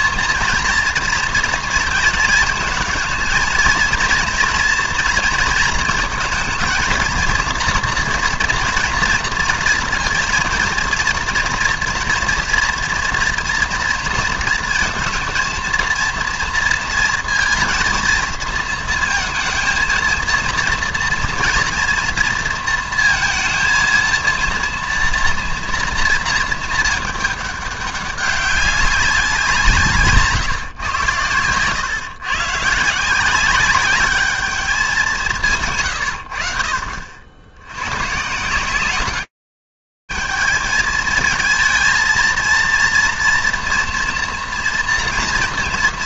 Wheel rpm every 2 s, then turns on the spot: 230, 230, 230, 230, 230, 230, 230, 230, 230, 230, 230, 230, 230, 220, 190, 130, 140, 210, 60, 170, 220, 230, 230.
none